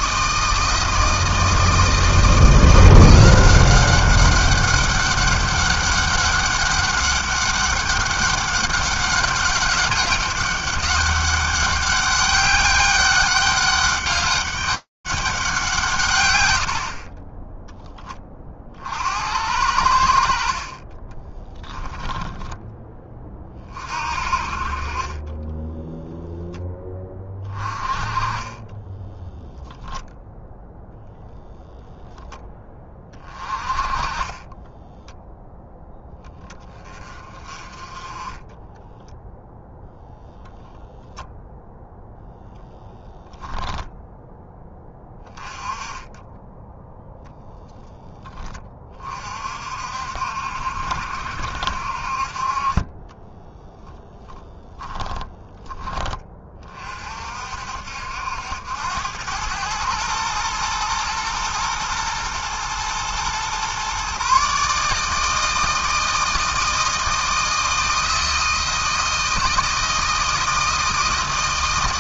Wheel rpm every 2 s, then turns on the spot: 160, 170, 190, 200, 200, 200, 200, 200, 60, 40, 50, 20, 50, 0, 20, 0, 20, 20, 20, 20, 0, 10, 10, 10, 10, 60, 40, 20, 40, 80, 110, 110, 140, 160, 160, 160.
22-24 28-30 34-36 54-56